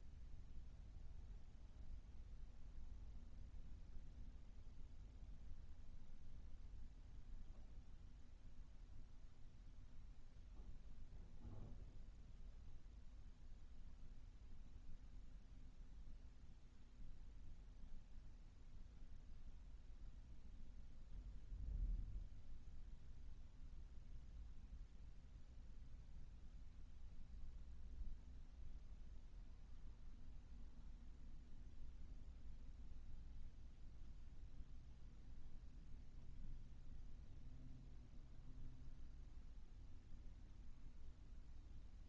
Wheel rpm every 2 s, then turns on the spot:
0, 0, 0, 0, 0, 0, 0, 0, 0, 0, 0, 0, 0, 0, 0, 0, 0, 0, 0, 0, 0.
none